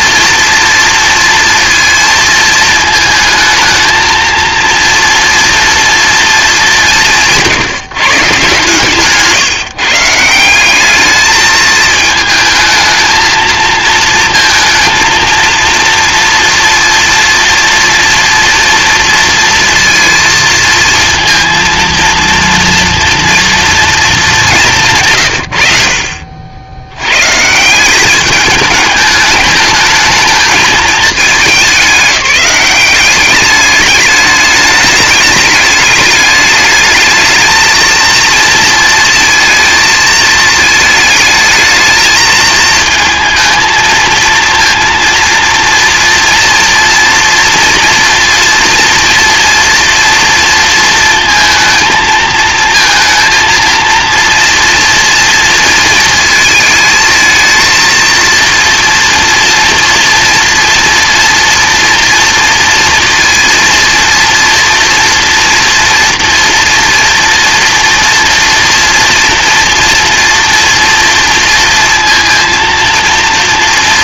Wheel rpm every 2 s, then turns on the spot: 230, 230, 230, 210, 140, 180, 220, 230, 230, 230, 230, 230, 200, 70, 210, 210, 200, 210, 210, 230, 220, 220, 230, 230, 230, 230, 230, 230, 220, 230, 240, 230, 230, 230, 230, 240, 230.
none